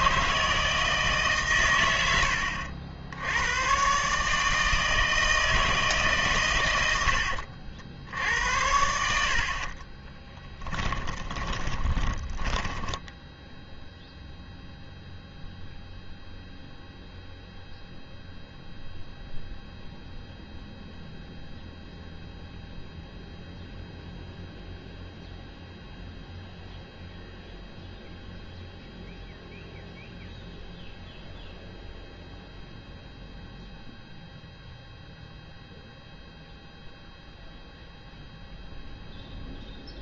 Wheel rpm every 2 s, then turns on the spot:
150, 80, 160, 100, 90, 10, 10, 0, 0, 0, 0, 0, 0, 0, 0, 0, 0, 0, 0, 0.
10-14